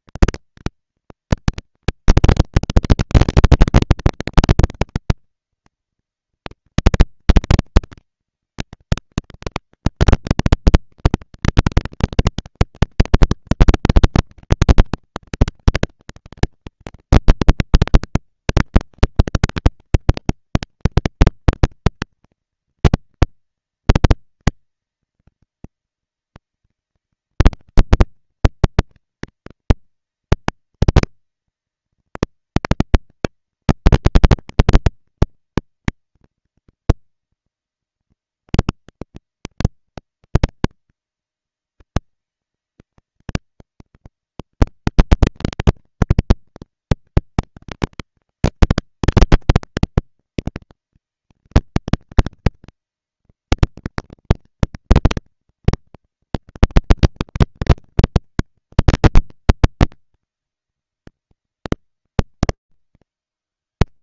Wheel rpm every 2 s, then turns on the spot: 220, 230, 230, 230, 230, 230, 230, 200, 190, 200, 230, 230, 230, 230, 230, 230, 220, 230, 230, 230, 230, 220, 230, 220, 220, 230, 230, 230, 230, 220, 200, 130.
none